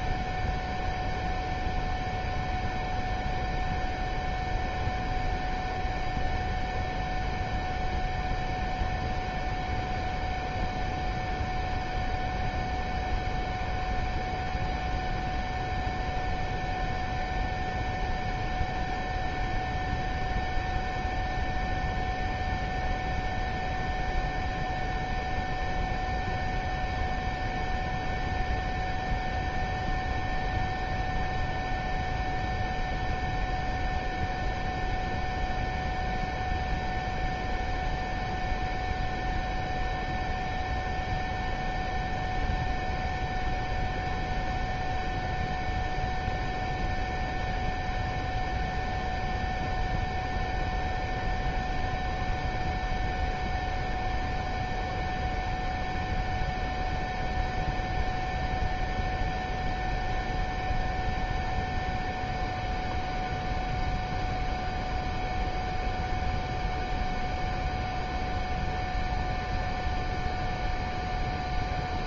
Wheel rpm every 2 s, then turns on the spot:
0, 0, 0, 0, 0, 0, 0, 0, 0, 0, 0, 0, 0, 0, 0, 0, 0, 0, 0, 0, 0, 0, 0, 0, 0, 0, 0, 0, 0, 0, 0, 0, 0, 0, 0, 0.
none